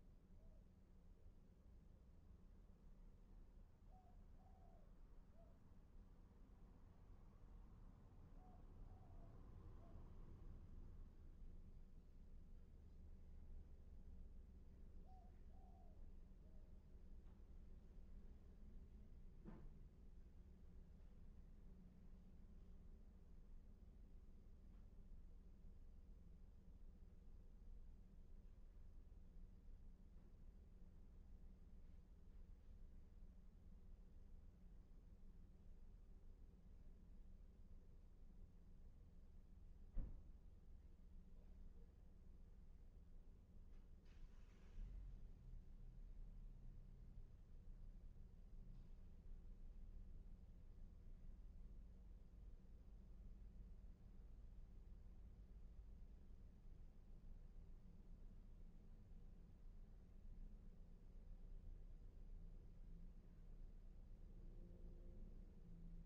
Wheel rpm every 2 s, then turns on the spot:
0, 0, 0, 0, 0, 0, 0, 0, 0, 0, 0, 0, 0, 0, 0, 0, 0, 0, 0, 0, 0, 0, 0, 0, 0, 0, 0, 0, 0, 0, 0, 0, 0.
none